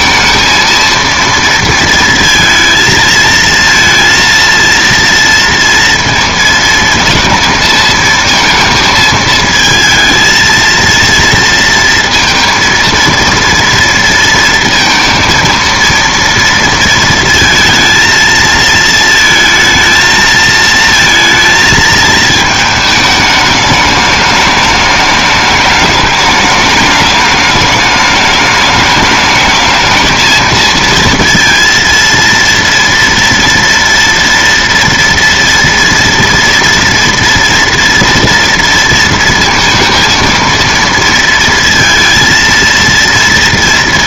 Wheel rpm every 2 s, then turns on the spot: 230, 220, 230, 230, 220, 230, 230, 230, 230, 220, 220, 220, 210, 210, 210, 220, 230, 230, 240, 230, 230, 230.
none